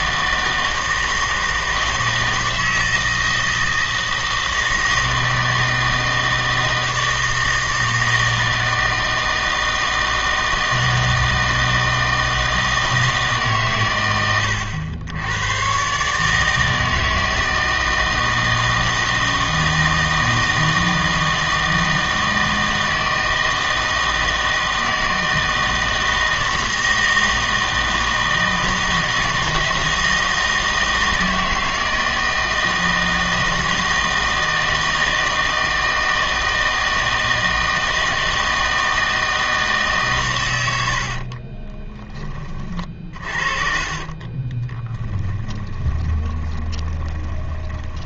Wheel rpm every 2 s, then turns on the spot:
160, 160, 160, 160, 160, 160, 160, 100, 160, 160, 160, 160, 160, 160, 160, 160, 160, 160, 160, 160, 90, 40, 20, 20.
44-48